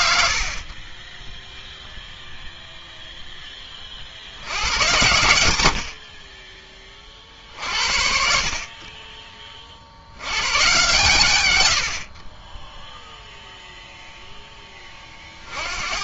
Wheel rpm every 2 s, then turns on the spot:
20, 0, 100, 40, 30, 120, 0, 50.
none